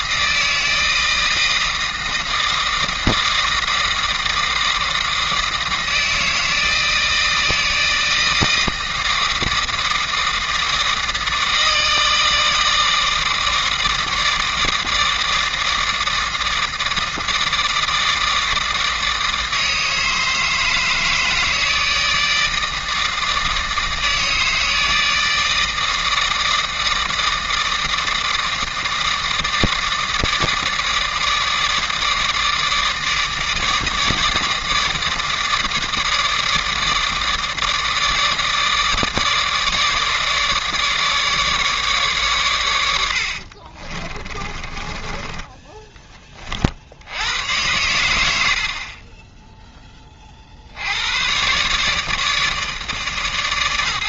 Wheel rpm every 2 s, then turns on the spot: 160, 160, 160, 160, 160, 160, 160, 160, 160, 160, 160, 160, 160, 160, 160, 160, 150, 150, 150, 150, 150, 100, 20, 60, 50, 70, 140.
44-46 48-50